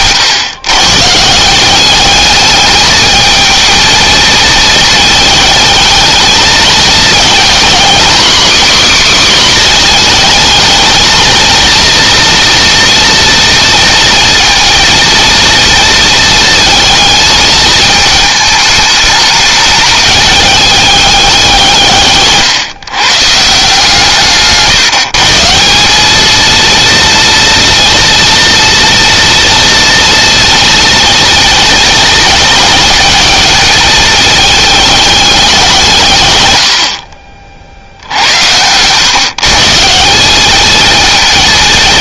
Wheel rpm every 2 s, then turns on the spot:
140, 220, 220, 220, 270, 220, 230, 230, 220, 210, 200, 140, 150, 230, 230, 230, 220, 220, 70, 110, 220.
none